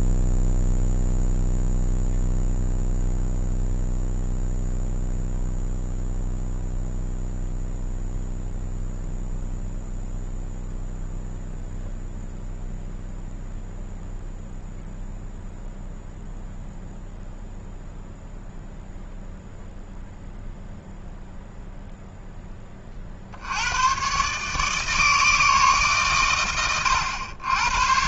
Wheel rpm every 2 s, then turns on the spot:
0, 0, 0, 0, 0, 0, 0, 0, 0, 0, 0, 70, 160, 80.
none